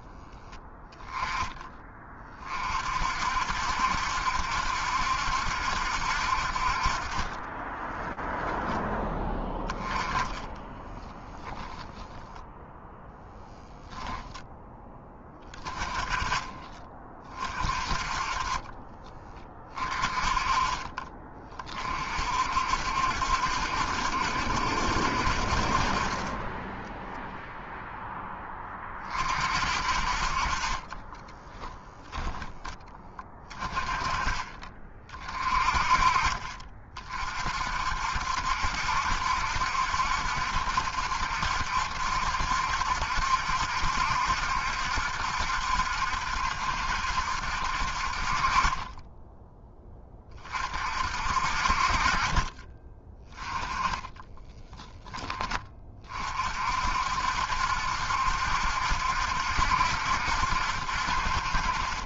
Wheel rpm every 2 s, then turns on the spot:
10, 30, 70, 60, 0, 10, 0, 0, 20, 30, 30, 50, 70, 30, 10, 40, 10, 30, 30, 60, 70, 70, 70, 70, 40, 30, 30, 10, 40, 70, 70.
10-12 54-56